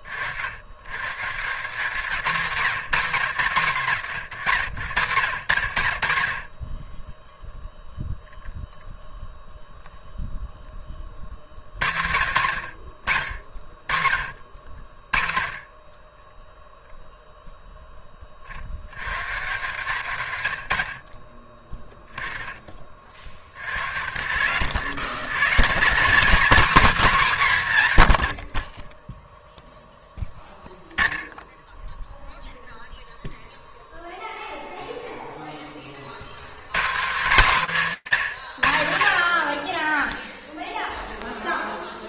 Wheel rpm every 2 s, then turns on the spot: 100, 180, 120, 30, 0, 10, 70, 60, 0, 70, 80, 30, 90, 250, 20, 0, 0, 0, 170, 110, 0.
none